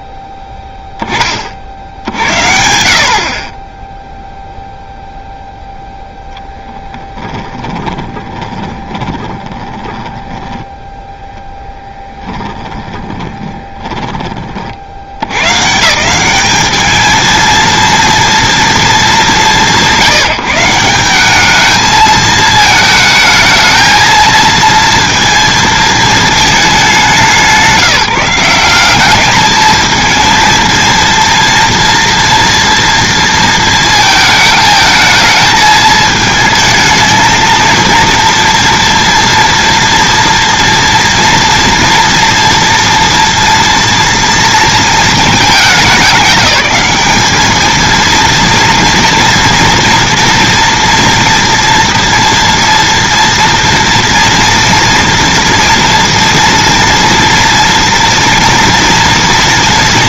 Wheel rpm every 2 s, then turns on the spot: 10, 60, 0, 10, 20, 10, 20, 60, 210, 230, 170, 220, 230, 220, 180, 230, 240, 220, 220, 240, 230, 230, 230, 210, 240, 230, 230, 230, 230, 230.
6-10 12-14